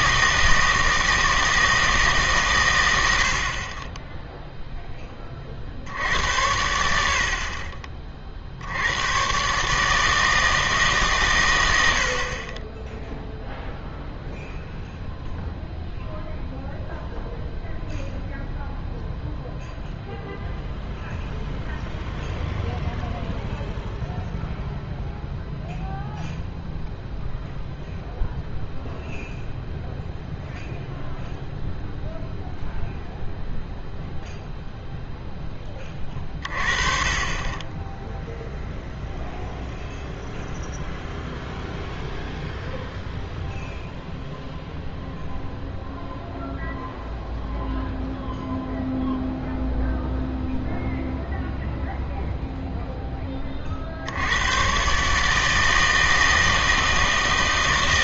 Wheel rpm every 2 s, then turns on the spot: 160, 120, 0, 70, 80, 160, 20, 0, 0, 0, 0, 0, 0, 0, 0, 0, 0, 0, 40, 0, 0, 0, 0, 0, 0, 0, 0, 120, 160.
none